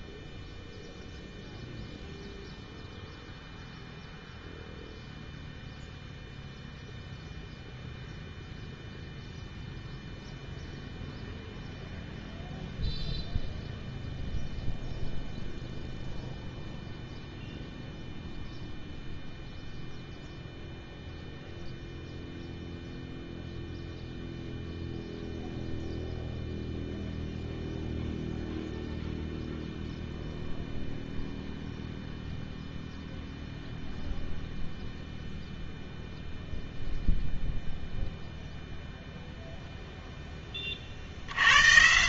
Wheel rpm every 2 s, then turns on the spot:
0, 0, 0, 0, 0, 0, 0, 0, 0, 0, 0, 0, 0, 0, 0, 0, 0, 0, 0, 0, 30.
none